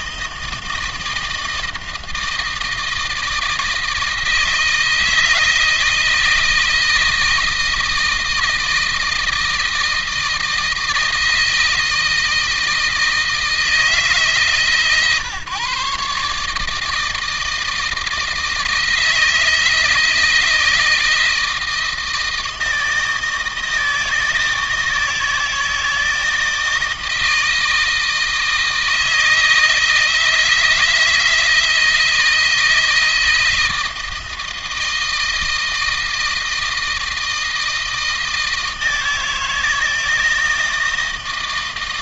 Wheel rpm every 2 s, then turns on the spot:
160, 160, 160, 160, 160, 160, 160, 140, 160, 160, 160, 160, 160, 160, 160, 160, 160, 160, 160, 160, 160.
none